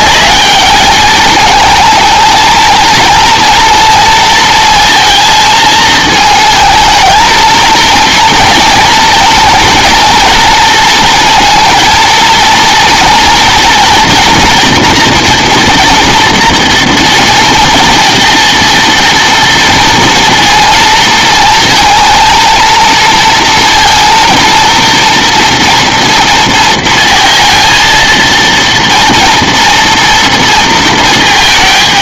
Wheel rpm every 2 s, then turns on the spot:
210, 230, 230, 220, 230, 230, 230, 230, 230, 230, 230, 230, 230, 230, 230, 230.
none